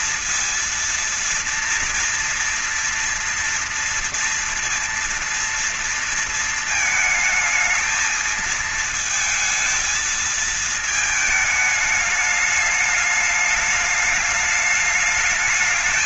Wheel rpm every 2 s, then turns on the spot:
230, 230, 230, 220, 220, 220, 210, 210.
none